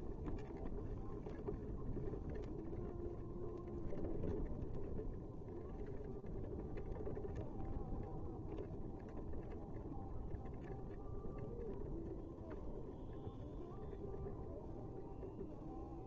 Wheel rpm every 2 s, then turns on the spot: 0, 0, 0, 0, 0, 0, 0, 0.
none